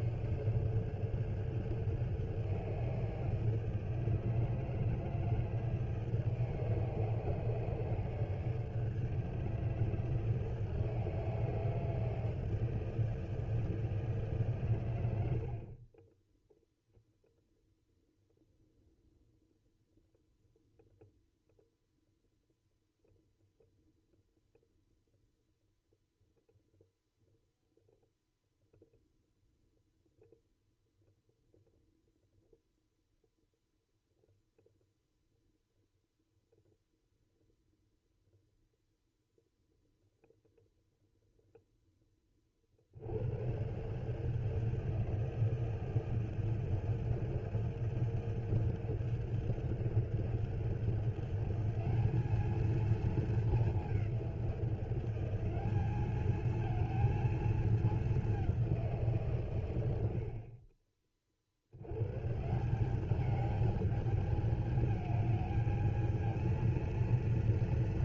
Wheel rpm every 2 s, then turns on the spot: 150, 160, 160, 150, 150, 160, 160, 140, 10, 0, 0, 0, 0, 0, 0, 0, 0, 0, 0, 0, 0, 30, 160, 160, 160, 170, 220, 180, 220, 190, 30, 160, 210, 230.
none